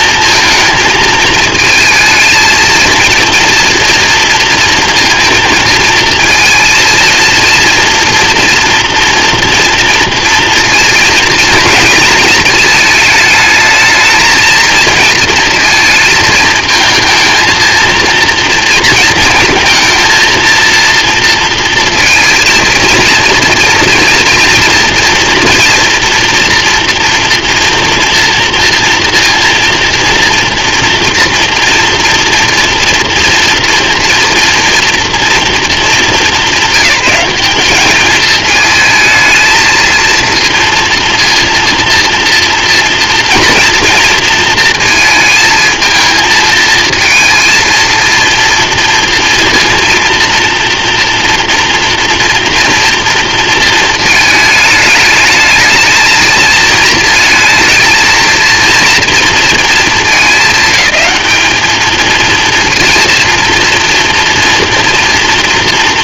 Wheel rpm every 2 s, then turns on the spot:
220, 230, 230, 230, 230, 230, 220, 230, 230, 230, 230, 230, 240, 230, 230, 240, 230, 230, 200, 220, 240, 240, 220, 230, 240, 230, 230, 220, 230, 230, 200, 230, 230.
none